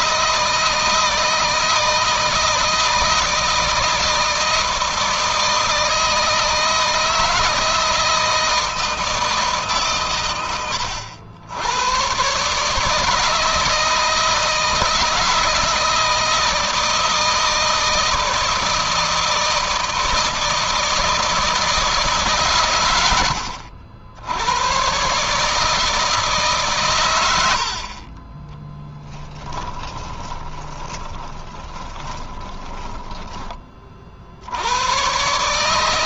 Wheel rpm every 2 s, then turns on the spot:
160, 160, 160, 160, 160, 100, 150, 160, 160, 160, 160, 110, 120, 120, 10, 20, 20, 110.
28-34